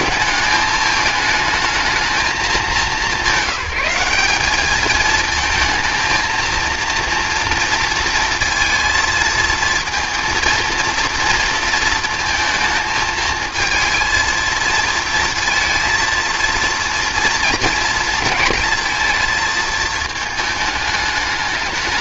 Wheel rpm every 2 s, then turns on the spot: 210, 200, 220, 230, 230, 230, 220, 220, 230, 230, 210.
none